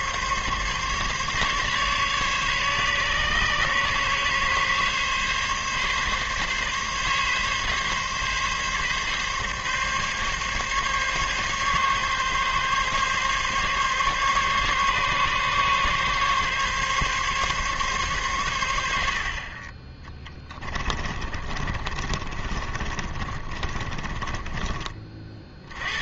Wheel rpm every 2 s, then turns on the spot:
140, 140, 140, 140, 140, 140, 140, 140, 140, 80, 20, 40, 30.
20-24